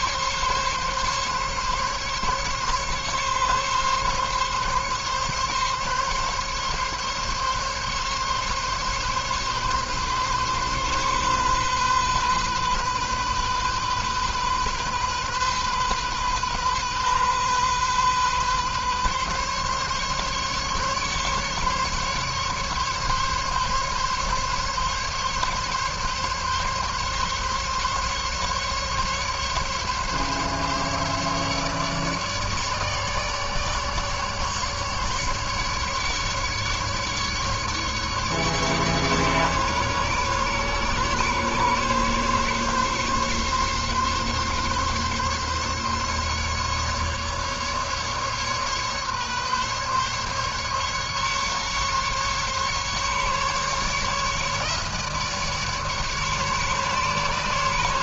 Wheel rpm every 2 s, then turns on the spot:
140, 140, 140, 140, 140, 140, 130, 130, 130, 130, 140, 140, 140, 140, 140, 140, 150, 150, 150, 150, 140, 140, 140, 140, 140, 140, 140, 150, 150.
none